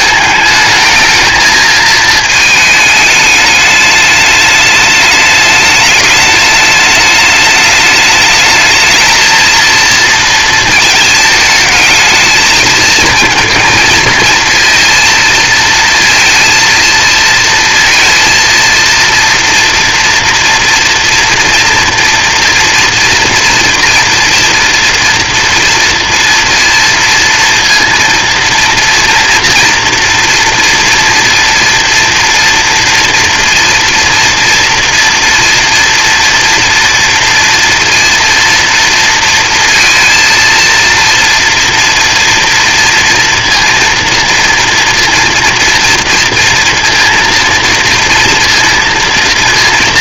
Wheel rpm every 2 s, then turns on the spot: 220, 220, 210, 210, 210, 230, 220, 230, 230, 230, 230, 240, 230, 230, 230, 230, 230, 230, 230, 230, 230, 230, 230, 230, 230.
none